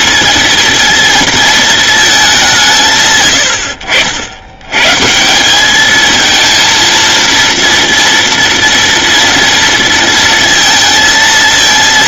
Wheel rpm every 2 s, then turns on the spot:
230, 150, 120, 230, 230, 230.
none